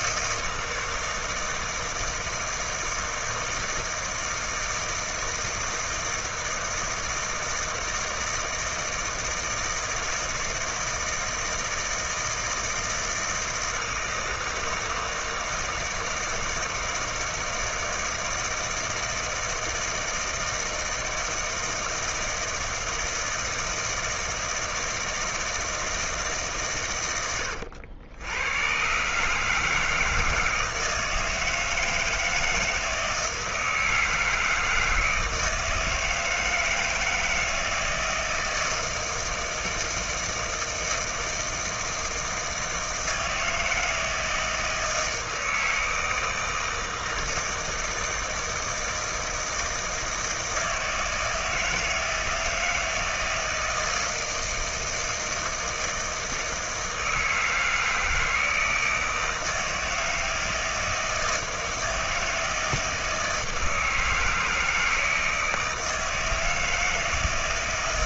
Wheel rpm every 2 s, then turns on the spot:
160, 160, 160, 160, 160, 160, 160, 160, 160, 160, 160, 160, 160, 140, 100, 160, 160, 160, 160, 160, 160, 160, 160, 160, 160, 160, 160, 160, 160, 160, 160, 160, 160, 160.
none